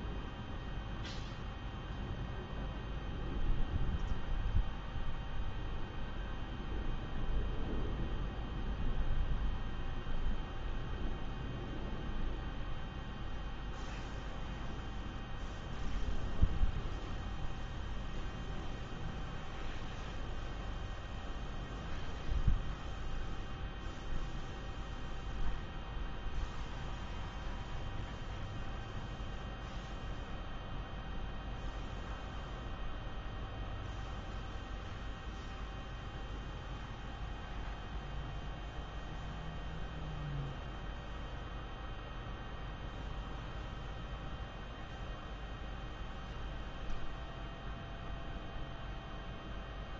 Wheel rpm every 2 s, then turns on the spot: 0, 0, 0, 0, 0, 0, 0, 0, 0, 0, 0, 0, 0, 0, 0, 0, 0, 0, 0, 0, 0, 0, 0, 0, 0.
none